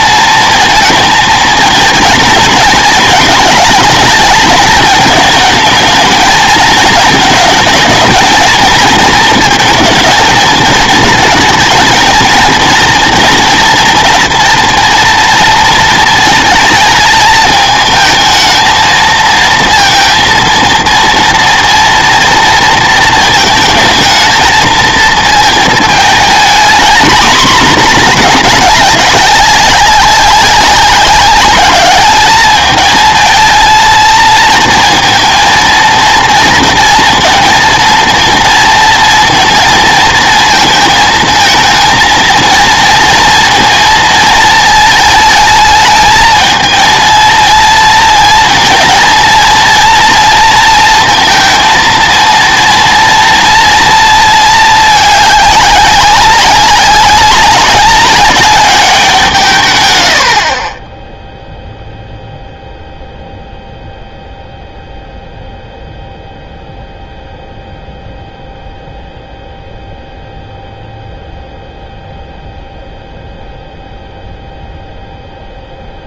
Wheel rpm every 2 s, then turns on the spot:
230, 230, 220, 220, 230, 230, 230, 230, 230, 220, 230, 230, 230, 230, 210, 200, 220, 220, 230, 230, 220, 230, 220, 220, 230, 230, 230, 220, 190, 200, 30, 0, 0, 0, 0, 0, 0, 0.
none